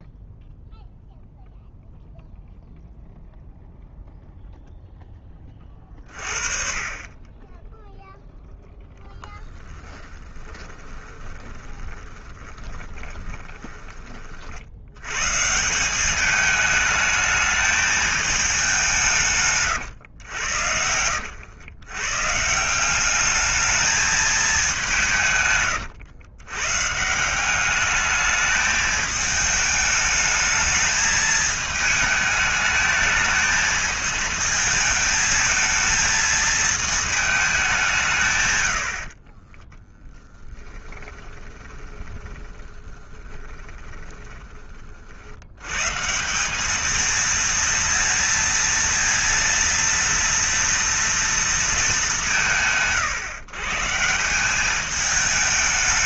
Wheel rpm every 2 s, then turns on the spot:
0, 0, 0, 30, 0, 20, 20, 60, 210, 210, 110, 160, 200, 120, 220, 210, 210, 220, 220, 120, 20, 20, 30, 190, 230, 230, 120, 190.
10-14 40-44